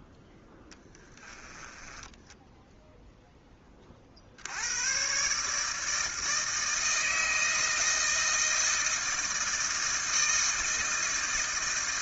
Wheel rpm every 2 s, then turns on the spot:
0, 0, 100, 160, 160, 160.
none